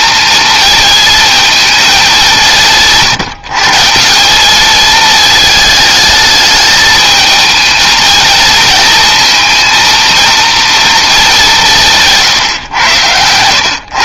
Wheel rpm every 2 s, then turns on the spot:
220, 150, 220, 220, 220, 220, 120.
12-14